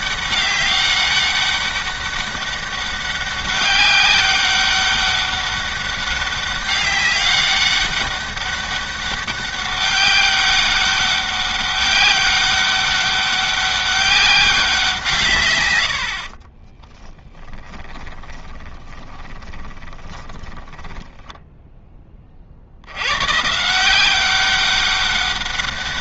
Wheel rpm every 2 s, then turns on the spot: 200, 200, 200, 200, 200, 200, 200, 180, 20, 20, 10, 50, 190.
16-22